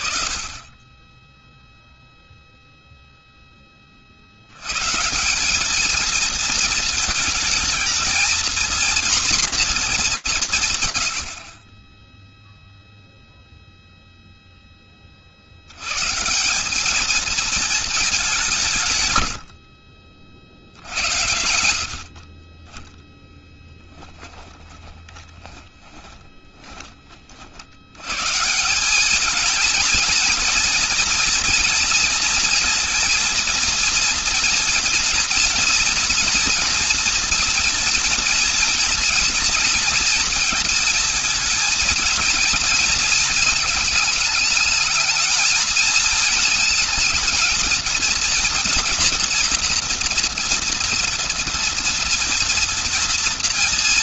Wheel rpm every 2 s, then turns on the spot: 30, 0, 120, 220, 240, 130, 0, 40, 220, 120, 80, 10, 30, 40, 210, 230, 230, 240, 230, 230, 230, 230, 220, 220, 230, 230, 240.
18-20 22-26